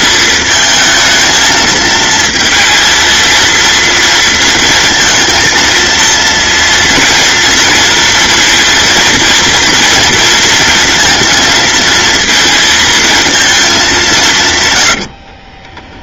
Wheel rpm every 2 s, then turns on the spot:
220, 220, 230, 230, 230, 230, 220, 110.
none